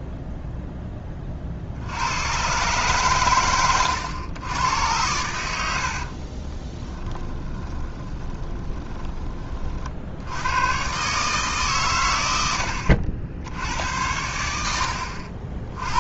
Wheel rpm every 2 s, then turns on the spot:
10, 130, 110, 20, 20, 120, 80, 80.
6-10 12-14